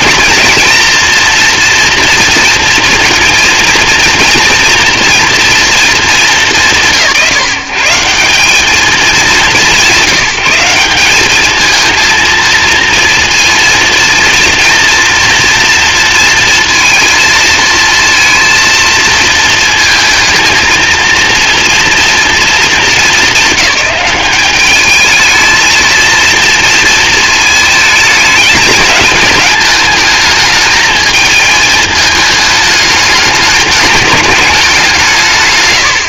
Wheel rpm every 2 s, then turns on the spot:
230, 230, 230, 170, 220, 190, 230, 240, 230, 230, 230, 220, 210, 230, 210, 220, 210, 190.
none